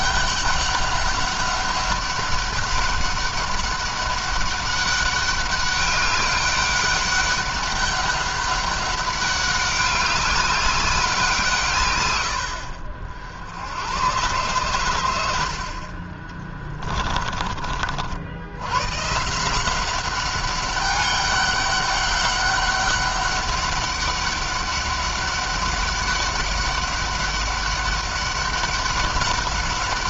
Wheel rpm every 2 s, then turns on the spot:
200, 200, 200, 200, 200, 200, 70, 120, 30, 100, 190, 200, 200, 200, 200.
16-18